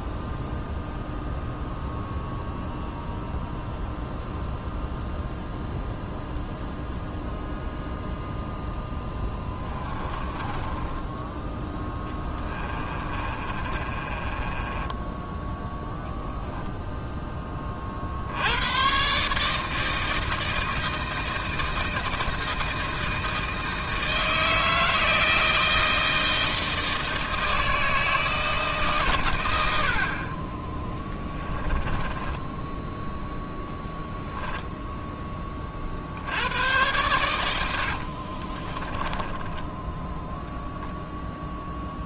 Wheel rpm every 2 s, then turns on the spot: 0, 0, 0, 0, 0, 20, 20, 20, 10, 110, 160, 160, 160, 160, 150, 20, 10, 10, 100, 20, 0.
10-16 32-34 38-40